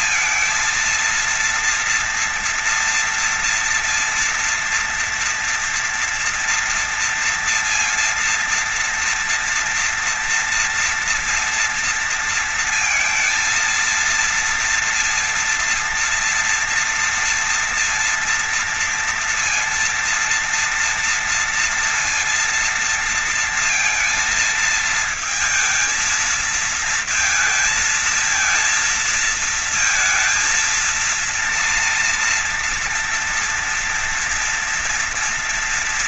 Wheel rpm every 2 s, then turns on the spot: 230, 230, 230, 230, 230, 230, 230, 230, 230, 230, 230, 230, 220, 220, 220, 230, 230, 240.
none